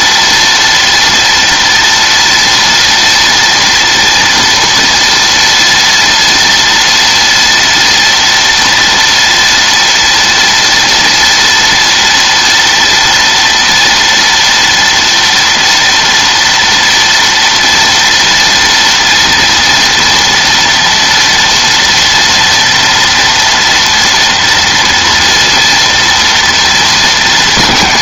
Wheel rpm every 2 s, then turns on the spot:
230, 230, 230, 230, 230, 230, 230, 240, 230, 230, 230, 230, 230, 230.
none